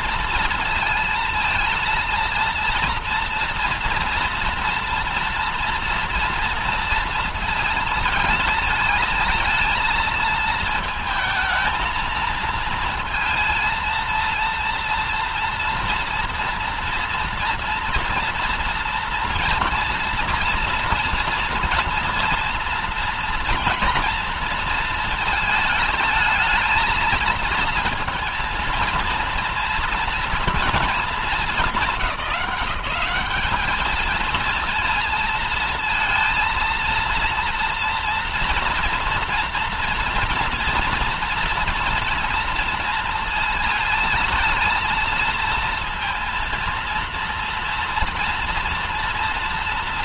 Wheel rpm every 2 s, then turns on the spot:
230, 230, 230, 230, 220, 220, 230, 230, 230, 230, 230, 240, 230, 220, 230, 230, 200, 220, 230, 230, 230, 230, 220, 230, 230.
none